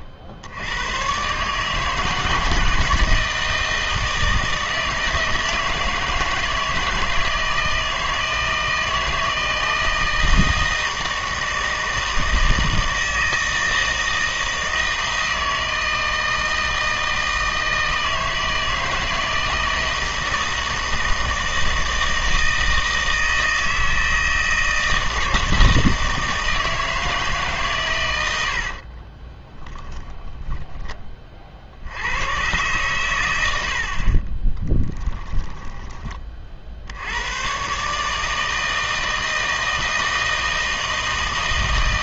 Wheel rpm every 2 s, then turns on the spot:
90, 160, 160, 160, 160, 160, 160, 160, 160, 160, 160, 160, 160, 160, 60, 10, 120, 20, 60, 160, 160.
28-30 34-36